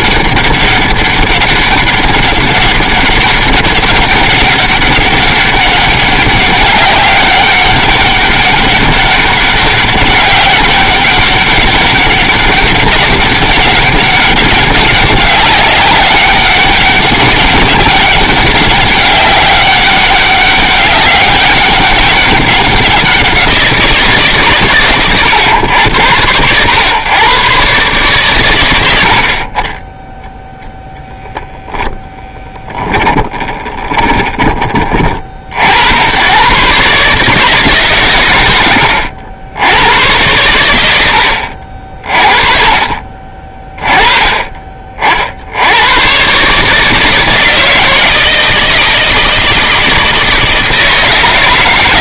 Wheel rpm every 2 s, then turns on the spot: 200, 200, 200, 200, 200, 190, 200, 200, 200, 200, 200, 190, 120, 110, 100, 0, 10, 30, 140, 90, 90, 50, 40, 150, 160, 160.
32-34